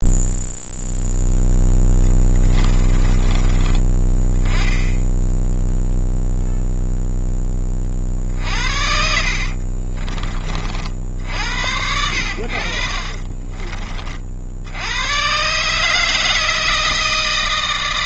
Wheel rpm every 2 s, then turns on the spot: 0, 20, 10, 0, 60, 50, 40, 90, 160.
2-4 8-10 12-14